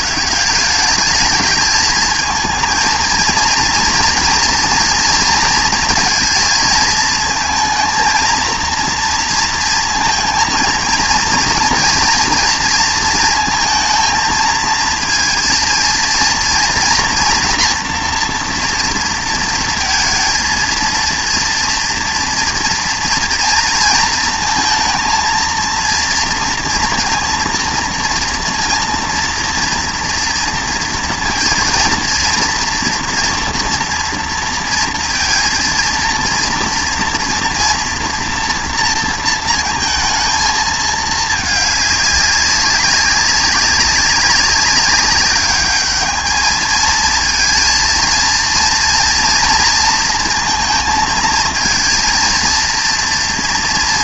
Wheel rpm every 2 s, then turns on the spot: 200, 220, 230, 230, 230, 230, 230, 230, 240, 230, 230, 230, 220, 230, 230, 230, 230, 230, 230, 230, 220, 200, 200, 220, 240, 230, 230.
none